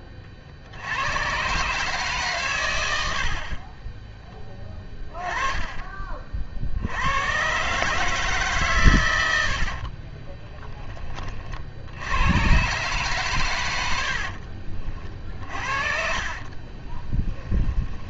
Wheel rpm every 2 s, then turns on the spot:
50, 140, 10, 60, 140, 20, 130, 50, 30.
10-12 16-18